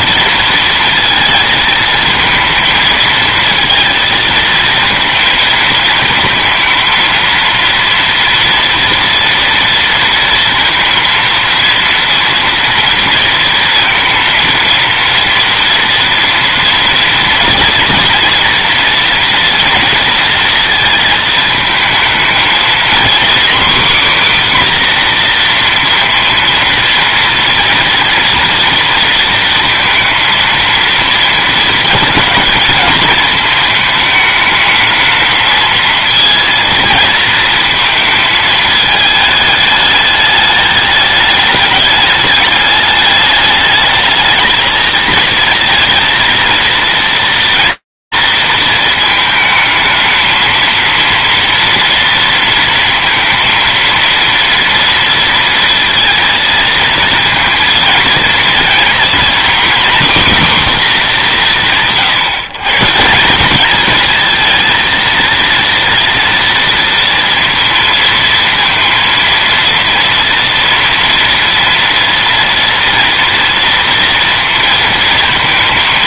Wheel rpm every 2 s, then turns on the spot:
230, 220, 230, 230, 230, 230, 230, 230, 230, 240, 230, 230, 260, 230, 230, 220, 220, 220, 230, 220, 210, 210, 220, 230, 220, 230, 230, 230, 230, 240, 220, 170, 230, 230, 230, 230, 230, 230.
none